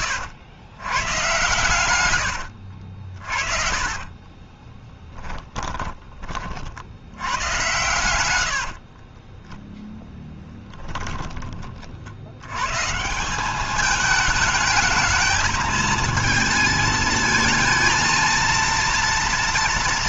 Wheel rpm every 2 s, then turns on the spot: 110, 50, 20, 90, 40, 10, 160, 220, 220, 230.
4-6 8-10